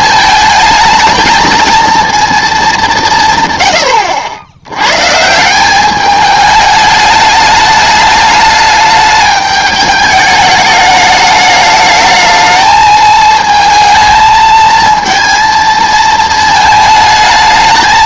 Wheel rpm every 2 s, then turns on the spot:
220, 210, 100, 210, 210, 210, 220, 220, 220.
none